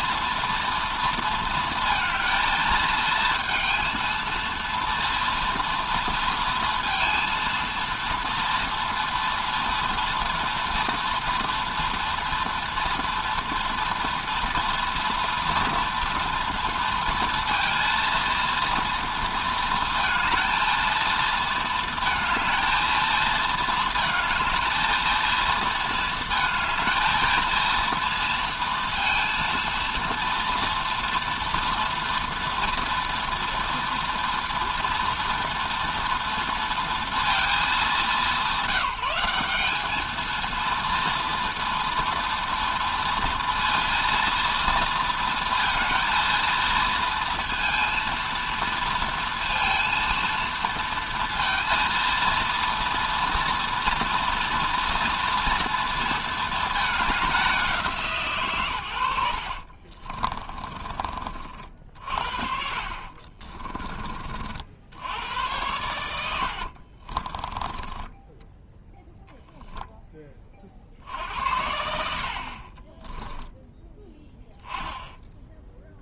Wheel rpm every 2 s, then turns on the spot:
230, 220, 230, 230, 230, 230, 240, 230, 230, 230, 230, 220, 220, 220, 230, 230, 230, 230, 230, 200, 230, 230, 220, 230, 230, 230, 230, 230, 220, 90, 30, 50, 70, 50, 0, 50, 30, 10.
58-64 66-68 72-74